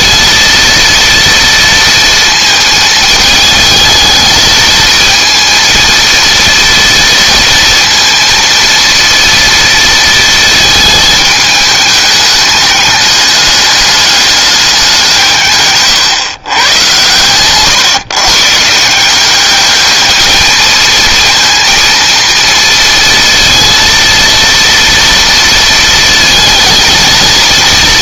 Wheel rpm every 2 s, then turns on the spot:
230, 220, 220, 230, 230, 220, 210, 190, 110, 160, 220, 230, 230, 220.
none